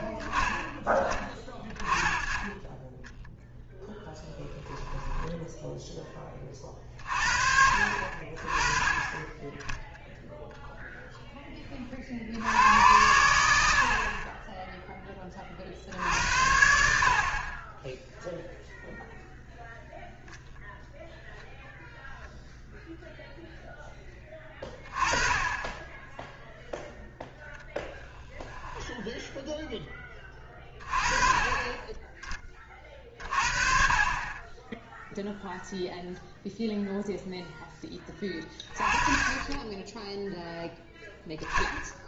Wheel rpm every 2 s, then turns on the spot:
20, 20, 10, 40, 30, 0, 90, 10, 80, 0, 0, 0, 20, 0, 10, 20, 30, 10, 0, 30, 0.
4-6 28-30